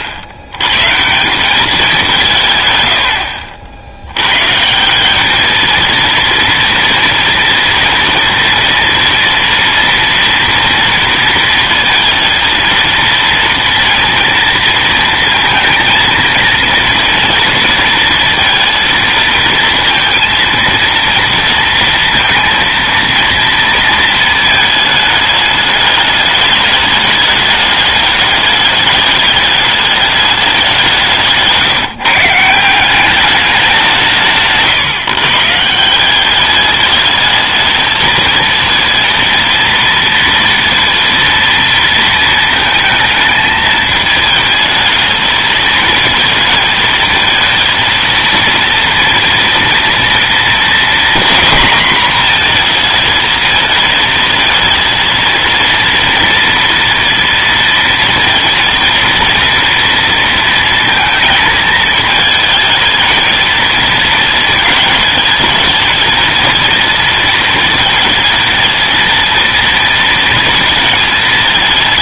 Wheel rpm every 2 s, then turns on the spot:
110, 110, 170, 230, 230, 230, 230, 230, 230, 230, 230, 230, 220, 210, 210, 180, 170, 150, 210, 230, 230, 220, 220, 230, 230, 240, 230, 230, 240, 230, 230, 220, 220, 230, 220, 230.
none